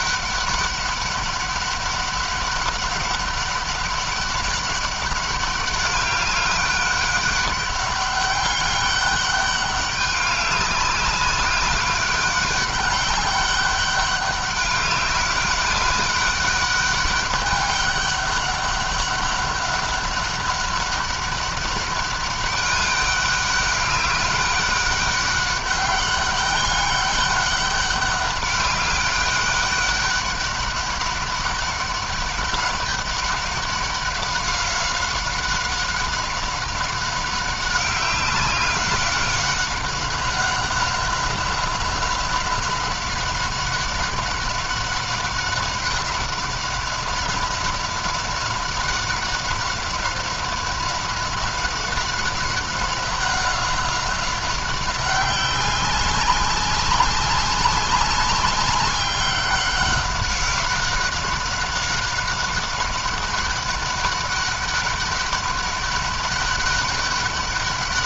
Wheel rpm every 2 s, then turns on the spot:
200, 200, 200, 200, 200, 200, 200, 200, 200, 200, 200, 200, 200, 200, 200, 200, 200, 190, 190, 190, 190, 190, 200, 190, 190, 190, 190, 190, 190, 190, 190, 190, 200, 200.
none